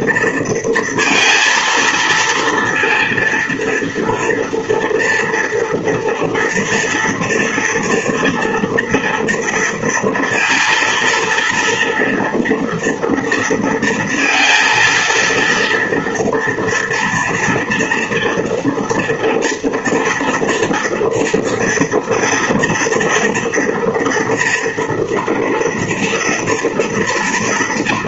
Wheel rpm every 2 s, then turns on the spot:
230, 230, 230, 230, 230, 230, 230, 230, 230, 230, 230, 230, 240, 230.
none